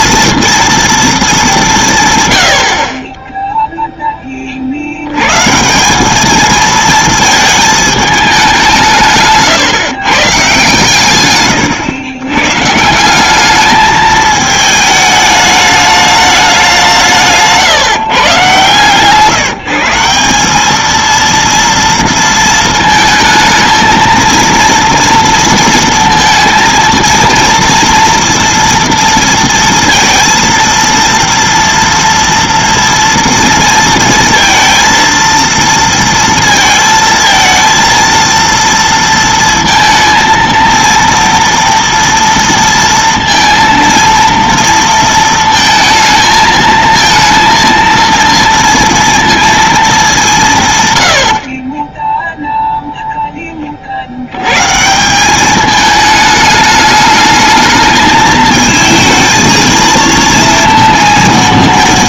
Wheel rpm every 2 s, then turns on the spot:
230, 100, 90, 230, 170, 140, 160, 220, 190, 130, 220, 220, 230, 230, 230, 230, 230, 230, 230, 230, 230, 230, 230, 230, 230, 120, 0, 150, 210, 220, 230.
none